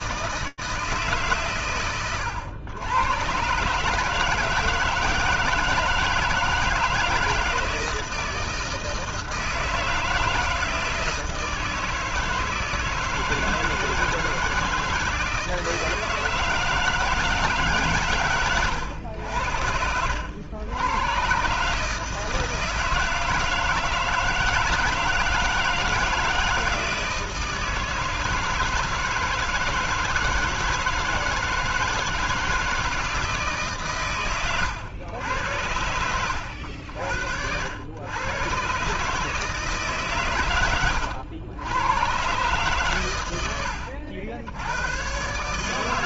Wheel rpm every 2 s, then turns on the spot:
100, 150, 160, 160, 160, 160, 160, 160, 150, 80, 140, 160, 160, 160, 160, 160, 150, 90, 80, 150, 90, 90, 130.
none